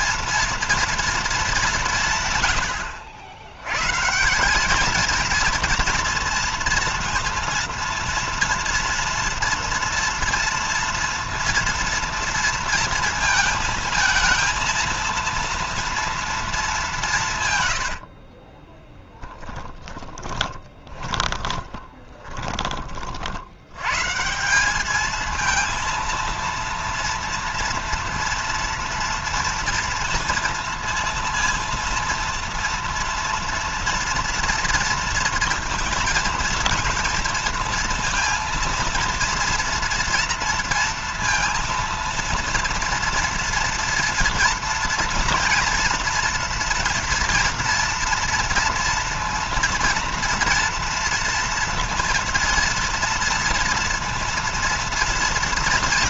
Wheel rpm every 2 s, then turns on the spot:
230, 110, 210, 230, 230, 230, 230, 230, 190, 20, 20, 30, 200, 230, 230, 230, 230, 230, 230, 230, 230, 230, 230, 230, 230, 230, 230, 230.
18-22